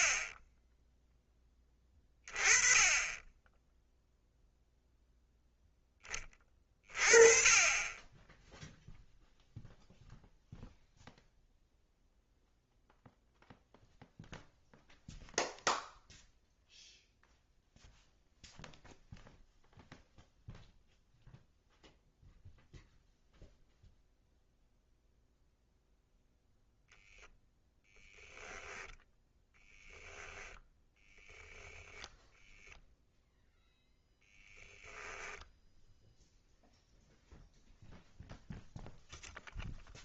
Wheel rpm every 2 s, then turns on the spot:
10, 20, 0, 30, 0, 0, 0, 0, 0, 0, 0, 0, 0, 0, 10, 0, 0, 0, 0, 0.
28-30